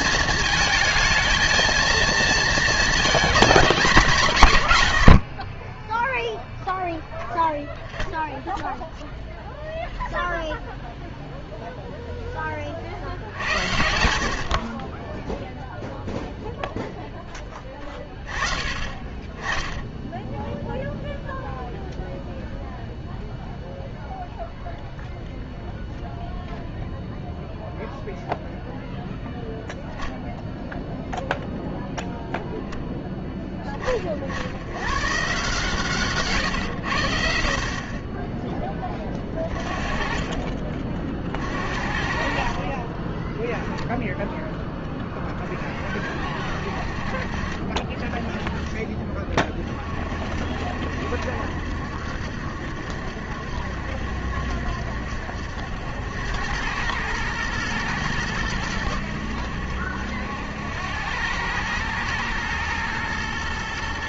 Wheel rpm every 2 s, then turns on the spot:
220, 230, 120, 0, 0, 0, 30, 30, 0, 30, 0, 0, 0, 0, 0, 0, 0, 70, 140, 20, 40, 40, 10, 60, 30, 60, 70, 70, 100, 100, 90, 110.
none